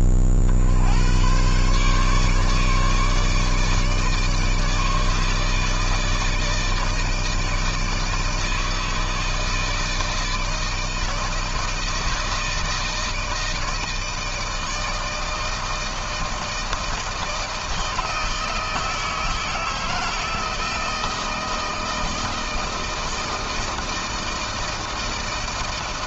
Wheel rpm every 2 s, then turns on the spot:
50, 150, 160, 160, 160, 160, 160, 160, 160, 160, 160, 160, 160.
none